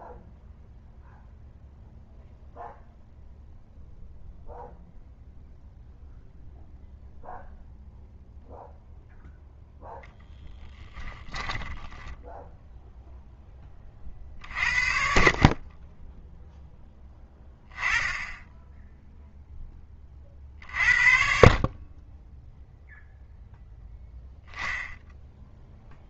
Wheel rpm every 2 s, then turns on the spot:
0, 0, 0, 0, 0, 10, 10, 50, 10, 0, 50, 0, 0.
10-12